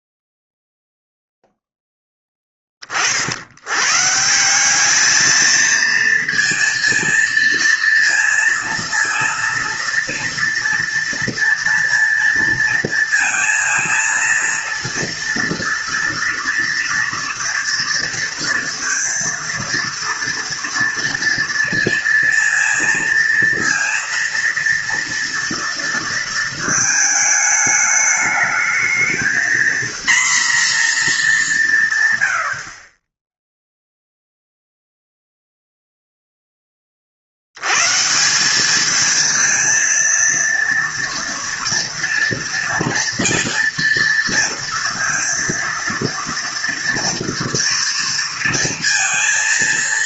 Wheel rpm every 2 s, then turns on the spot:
0, 20, 190, 230, 230, 230, 230, 230, 230, 230, 230, 230, 230, 220, 220, 230, 30, 0, 30, 210, 230, 230, 230, 240, 230.
none